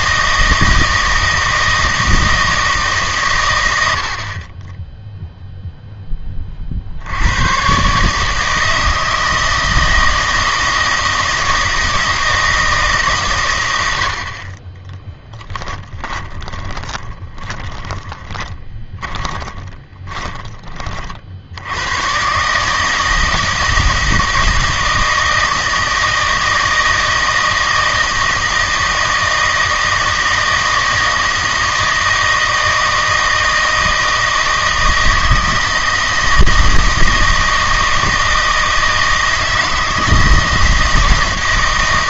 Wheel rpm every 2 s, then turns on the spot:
160, 150, 20, 50, 160, 160, 160, 20, 20, 20, 30, 150, 160, 160, 160, 160, 160, 160, 160, 160, 160.
16-20